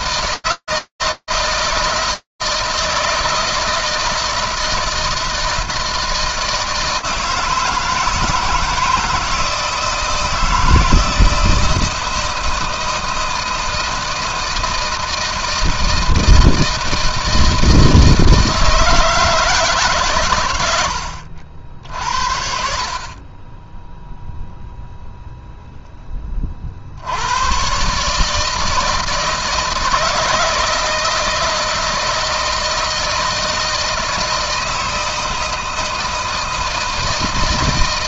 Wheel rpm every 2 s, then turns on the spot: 160, 160, 160, 160, 160, 160, 160, 160, 60, 30, 0, 70, 160, 160, 160, 160, 160, 160, 160.
none